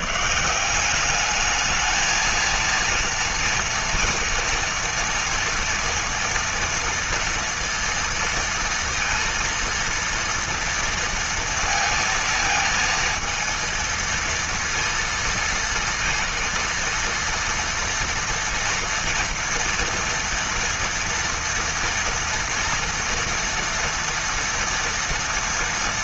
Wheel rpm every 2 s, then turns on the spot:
180, 230, 230, 230, 230, 230, 230, 230, 230, 230, 230, 230, 230.
none